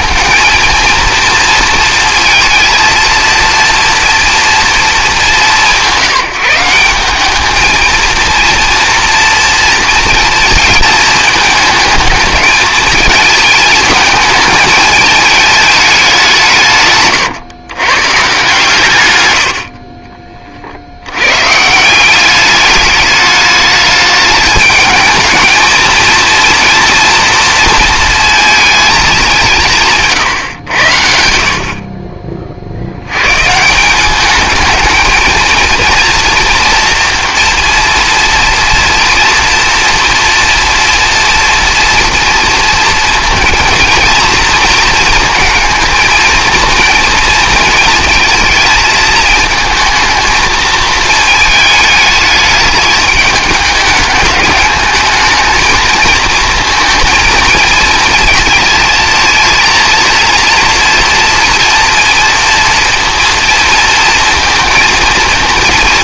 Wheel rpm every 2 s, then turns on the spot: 230, 230, 220, 170, 230, 220, 220, 220, 150, 140, 70, 210, 210, 230, 220, 90, 80, 220, 240, 230, 230, 230, 230, 230, 230, 220, 210, 210, 230, 220, 230, 230, 220.
none